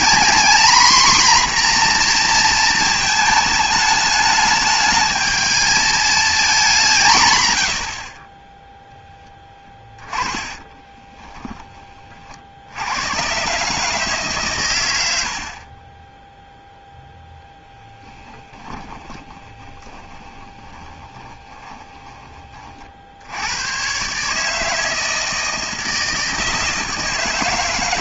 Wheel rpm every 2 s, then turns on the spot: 240, 230, 210, 210, 10, 20, 80, 110, 0, 10, 20, 50, 160, 160.
10-12 18-22